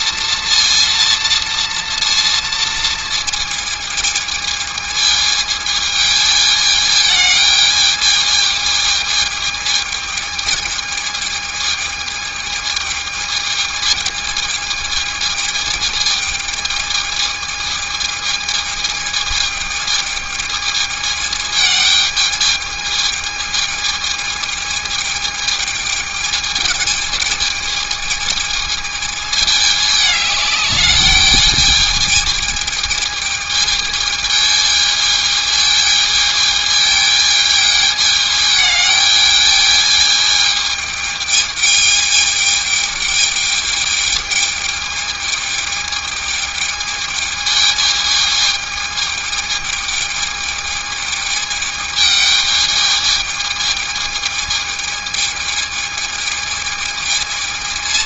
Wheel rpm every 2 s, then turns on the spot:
230, 220, 210, 210, 220, 210, 220, 220, 220, 210, 220, 220, 220, 210, 220, 210, 220, 220, 220, 220, 210, 210, 220, 220, 220, 220, 220, 220, 220.
none